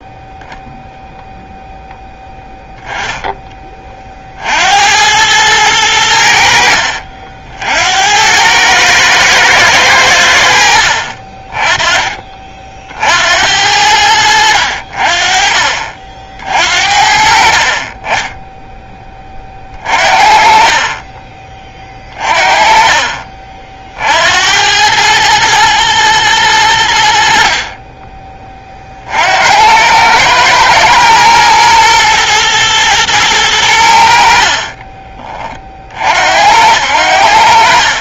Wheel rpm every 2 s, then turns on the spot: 0, 10, 80, 60, 110, 70, 50, 60, 50, 10, 30, 40, 90, 90, 30, 110, 120, 30, 80.
20-24 34-36